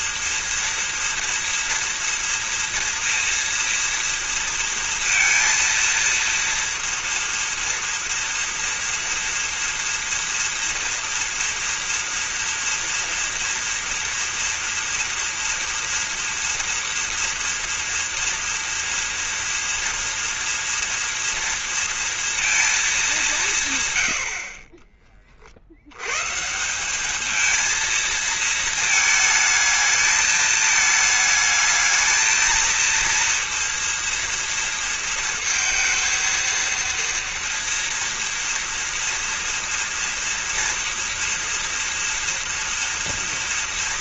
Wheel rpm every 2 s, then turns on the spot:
230, 240, 230, 230, 230, 230, 240, 240, 230, 230, 230, 230, 60, 160, 230, 220, 220, 230, 230, 230, 230, 230.
none